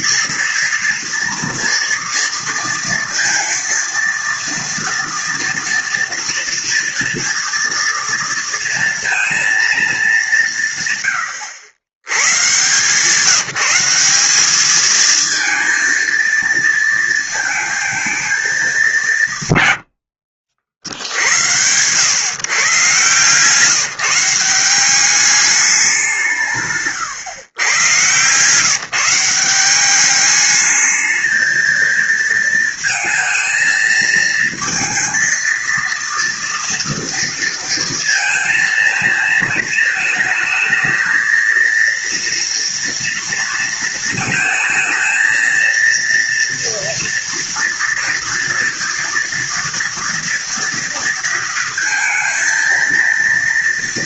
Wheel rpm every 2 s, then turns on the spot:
230, 230, 230, 230, 230, 110, 160, 230, 220, 170, 70, 140, 200, 120, 170, 220, 220, 230, 230, 220, 220, 230, 220, 230, 240, 230, 230.
none